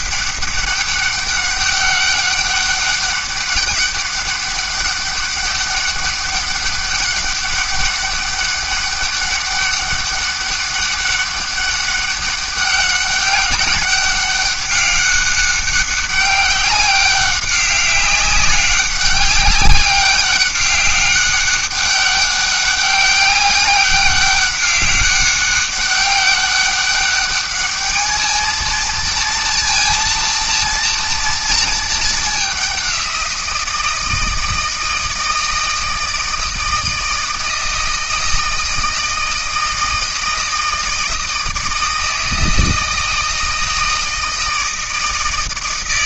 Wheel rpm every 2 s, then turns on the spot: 200, 200, 200, 190, 200, 200, 200, 200, 200, 200, 200, 200, 200, 200, 220, 230, 190, 160, 160, 160, 160, 160, 160.
none